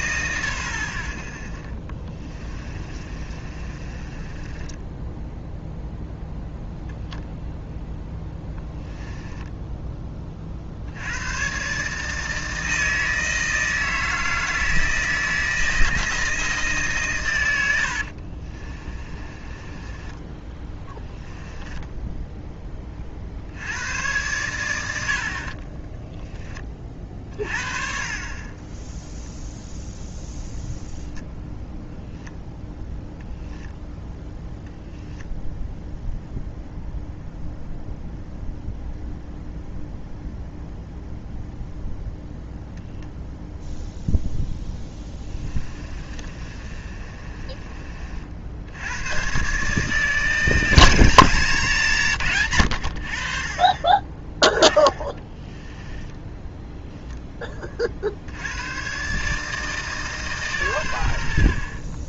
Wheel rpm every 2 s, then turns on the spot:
100, 30, 10, 0, 10, 70, 160, 160, 140, 30, 10, 20, 90, 30, 10, 0, 0, 0, 0, 0, 0, 0, 10, 30, 90, 170, 100, 10, 10, 120, 100.
2-6 8-10 18-22 44-48 54-56